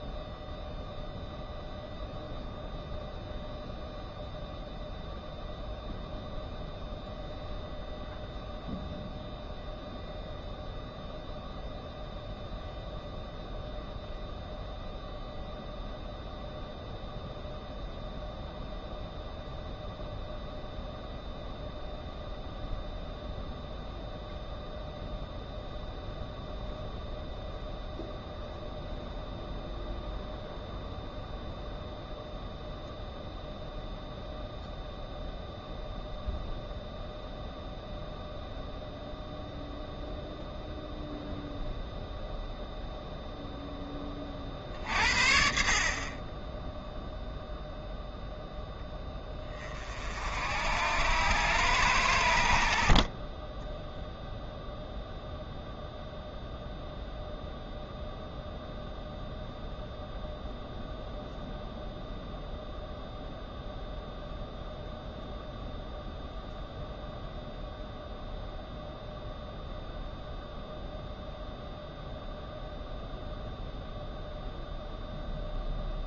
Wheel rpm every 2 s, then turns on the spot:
0, 0, 0, 0, 0, 0, 0, 0, 0, 0, 0, 0, 0, 0, 0, 0, 0, 0, 0, 0, 0, 0, 50, 0, 10, 80, 60, 0, 0, 0, 0, 0, 0, 0, 0, 0, 0, 0.
none